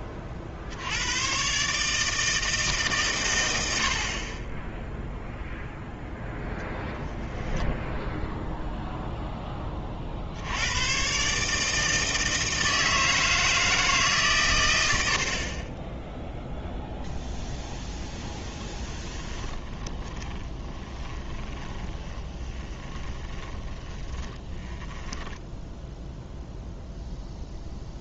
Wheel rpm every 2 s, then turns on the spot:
60, 150, 20, 0, 0, 90, 160, 100, 0, 10, 20, 20, 10, 0.
20-26